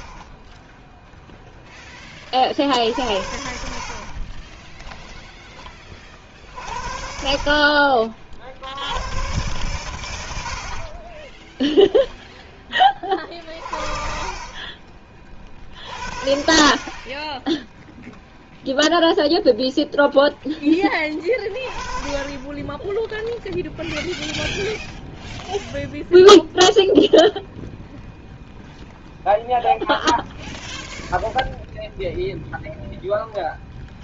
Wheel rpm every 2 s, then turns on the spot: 0, 70, 20, 50, 80, 60, 20, 40, 30, 0, 10, 10, 0, 0, 0, 0, 0.
4-6 10-12 14-16